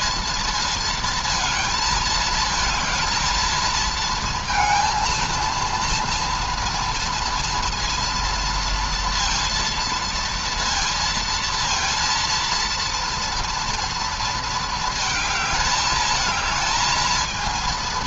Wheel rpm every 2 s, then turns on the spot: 230, 220, 230, 230, 240, 230, 230, 230, 220.
none